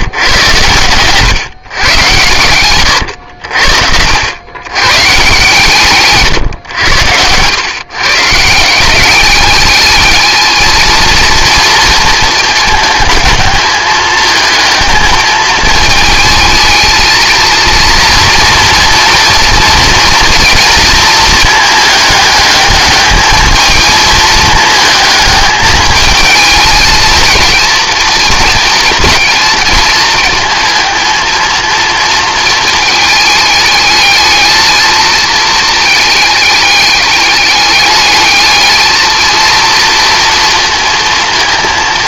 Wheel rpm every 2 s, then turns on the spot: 120, 120, 120, 100, 170, 220, 220, 220, 220, 230, 230, 210, 220, 220, 230, 220, 220, 220, 210, 220, 230.
6-8